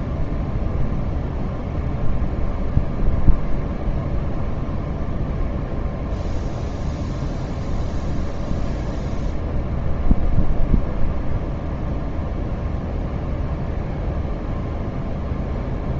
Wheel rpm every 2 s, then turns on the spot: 0, 0, 0, 0, 0, 0, 0, 0.
none